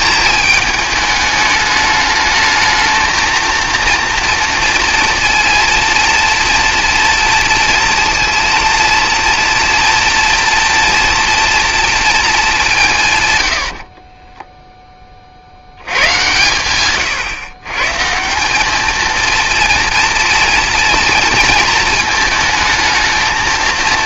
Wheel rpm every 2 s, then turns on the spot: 220, 220, 230, 230, 230, 240, 170, 10, 120, 210, 230, 220.
none